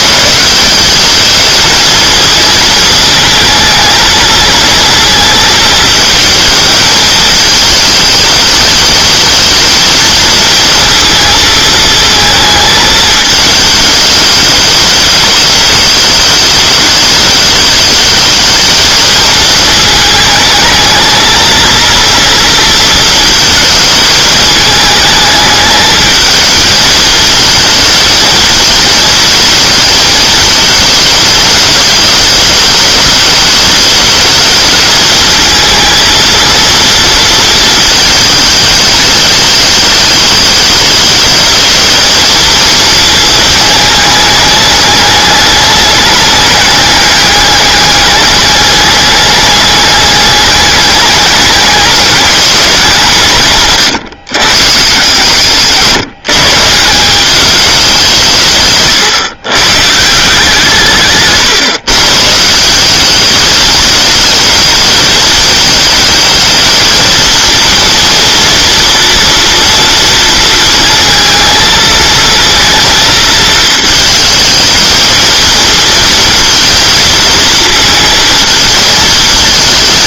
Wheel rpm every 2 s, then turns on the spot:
180, 220, 230, 220, 210, 230, 220, 210, 210, 220, 220, 230, 220, 220, 220, 220, 210, 220, 230, 220, 210, 230, 210, 210, 210, 200, 190, 130, 160, 130, 160, 180, 220, 220, 230, 220, 230, 220, 230, 220.
58-60